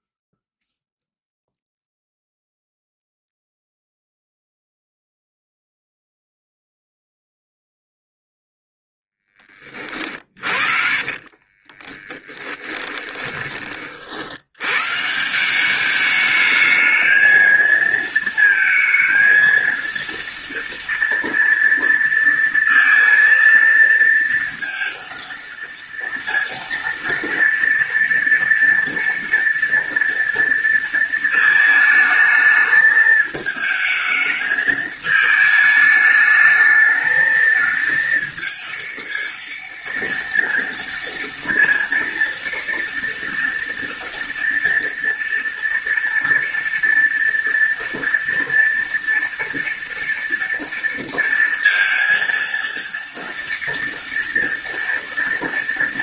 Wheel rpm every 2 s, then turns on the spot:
0, 0, 0, 0, 0, 50, 20, 150, 220, 230, 230, 230, 230, 230, 230, 230, 220, 220, 220, 230, 230, 230, 240, 230, 230, 230, 230, 230.
10-14